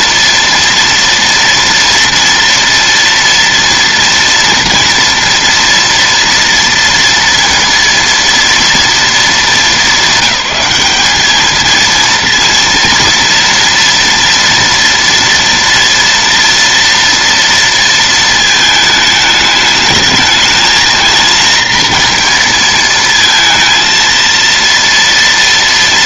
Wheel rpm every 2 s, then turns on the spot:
230, 230, 230, 230, 230, 200, 230, 230, 230, 220, 220, 230, 230.
none